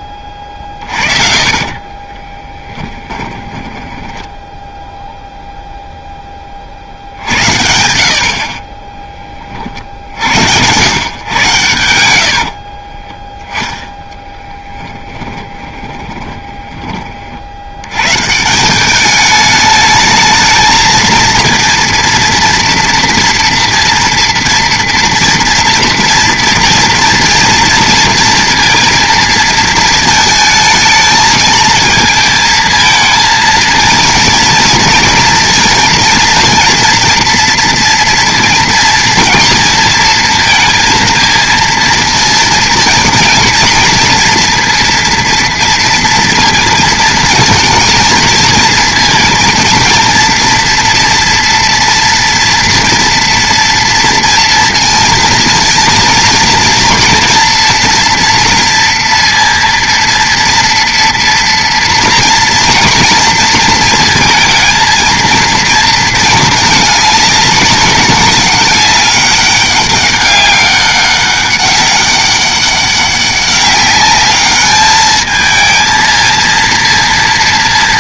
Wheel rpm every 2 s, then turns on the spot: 50, 20, 0, 60, 20, 110, 30, 10, 20, 200, 220, 230, 230, 230, 230, 220, 220, 230, 230, 230, 230, 230, 230, 230, 230, 230, 230, 230, 230, 230, 240, 230, 220, 210, 190, 200, 200, 210, 230.
0-4 12-16